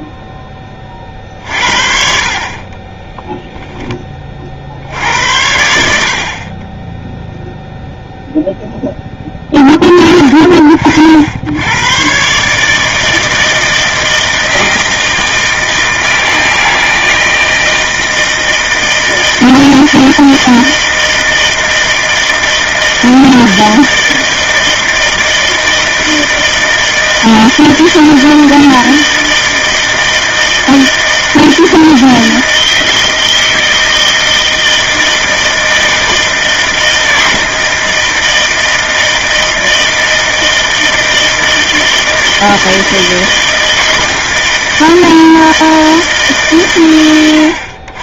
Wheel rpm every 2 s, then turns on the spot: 40, 20, 80, 0, 10, 60, 160, 160, 160, 160, 160, 160, 160, 160, 160, 160, 160, 160, 160, 160, 160, 160, 160, 100.
2-4